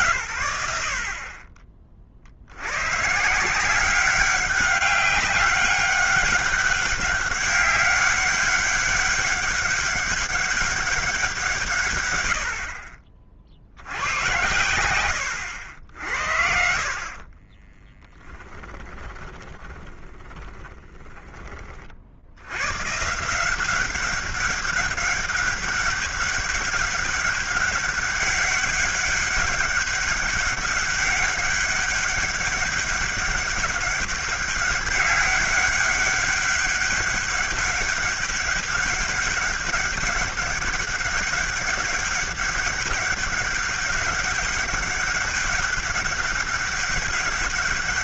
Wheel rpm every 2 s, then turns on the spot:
120, 90, 200, 200, 200, 200, 70, 100, 60, 20, 20, 110, 190, 200, 200, 200, 200, 200, 200, 200, 200, 200, 200, 200.
18-22